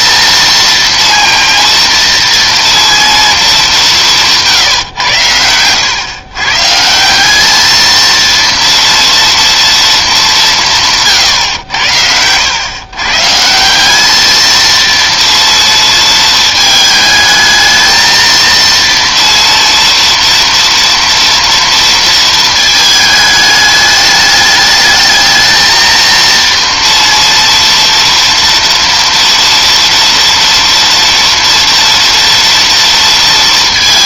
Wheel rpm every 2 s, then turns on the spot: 230, 230, 150, 140, 230, 180, 110, 230, 220, 230, 230, 220, 210, 230, 230, 230, 230.
none